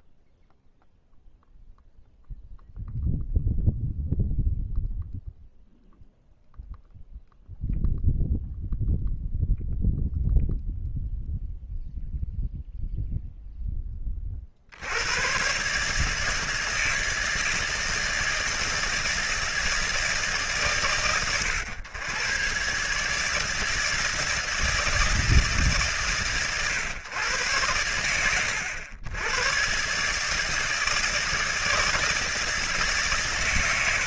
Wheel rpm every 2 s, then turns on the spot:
0, 0, 0, 0, 0, 0, 0, 100, 160, 160, 110, 140, 150, 110, 100, 160, 110.
none